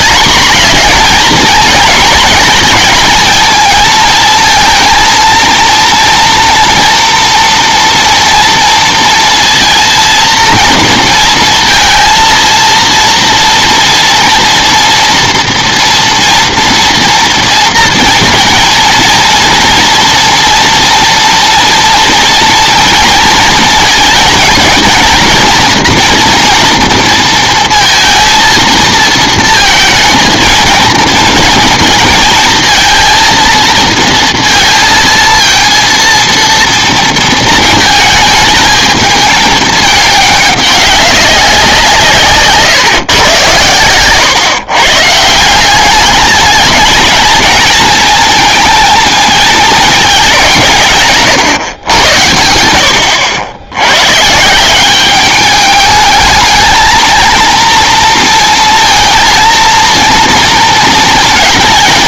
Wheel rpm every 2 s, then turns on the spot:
220, 230, 230, 230, 230, 230, 230, 240, 230, 230, 230, 230, 230, 230, 230, 230, 230, 230, 230, 220, 200, 140, 140, 210, 220, 160, 80, 170, 220, 230, 230.
none